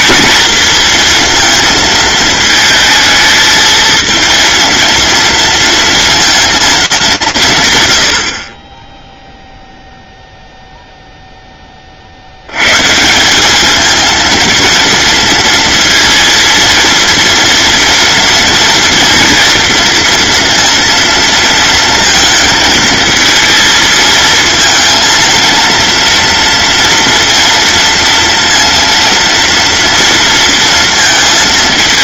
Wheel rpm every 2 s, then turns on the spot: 230, 220, 230, 230, 30, 0, 130, 230, 230, 230, 230, 220, 230, 230, 230, 230.
none